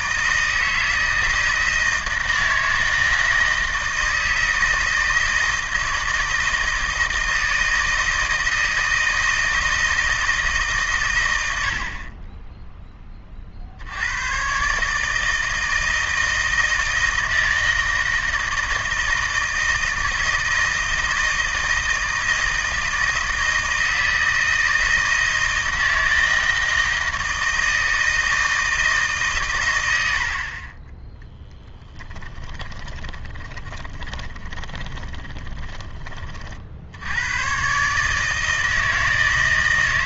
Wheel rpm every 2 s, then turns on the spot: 160, 160, 170, 160, 160, 130, 10, 150, 160, 160, 160, 160, 160, 160, 150, 20, 20, 20, 70, 160.
32-36